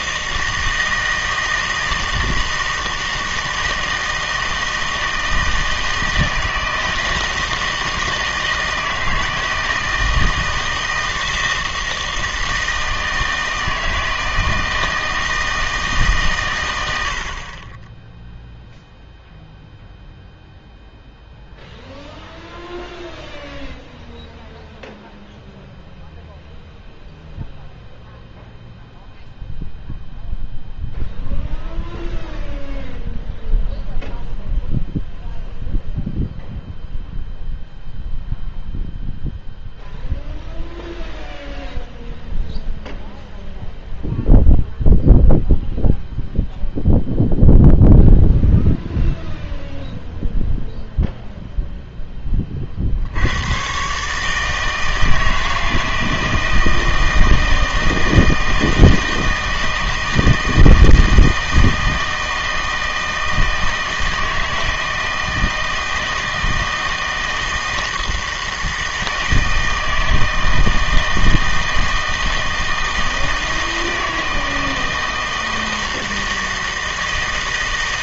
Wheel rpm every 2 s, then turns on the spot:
160, 160, 160, 160, 160, 160, 160, 160, 100, 0, 0, 0, 0, 0, 0, 0, 0, 0, 0, 0, 0, 0, 0, 0, 0, 0, 50, 160, 160, 160, 160, 160, 160, 160, 160, 160, 160, 160, 160.
none